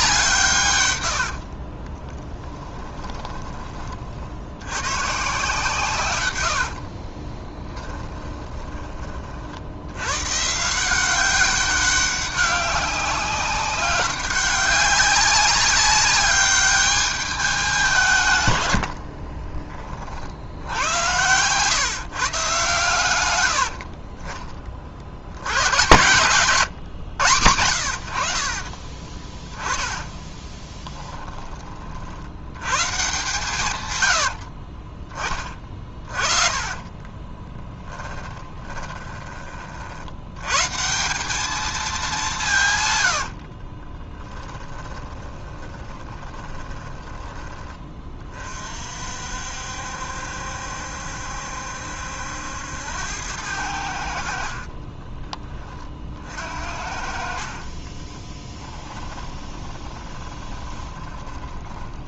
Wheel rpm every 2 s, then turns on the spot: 110, 10, 120, 50, 30, 170, 200, 200, 200, 100, 90, 120, 50, 130, 30, 10, 130, 30, 20, 20, 170, 110, 10, 20, 50, 70, 90, 30, 50, 20, 20.
2-4 6-8 18-20 28-32 34-40 44-48 54-56 58-62